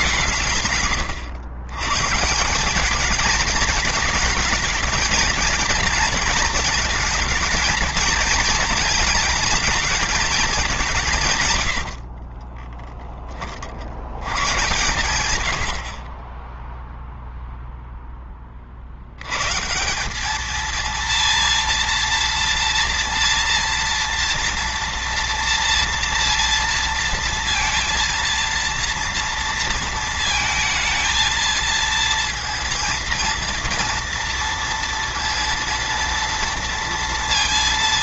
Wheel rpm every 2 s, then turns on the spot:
120, 190, 210, 220, 220, 200, 20, 130, 10, 50, 230, 230, 230, 230, 230, 220, 230, 230, 230.
12-14